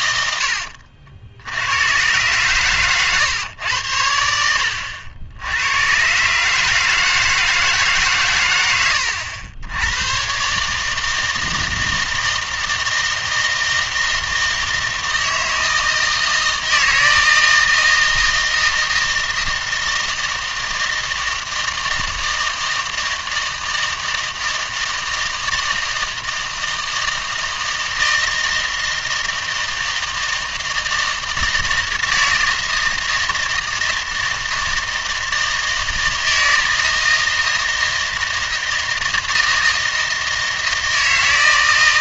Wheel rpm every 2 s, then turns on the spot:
80, 120, 80, 150, 100, 150, 160, 160, 160, 160, 160, 160, 160, 160, 160, 160, 160, 160, 160, 160, 160.
none